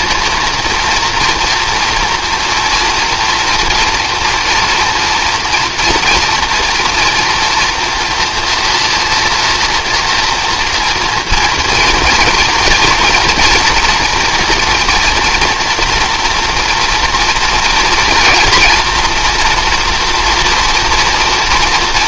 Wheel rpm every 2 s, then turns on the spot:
230, 230, 230, 240, 230, 230, 230, 240, 230, 230, 240.
none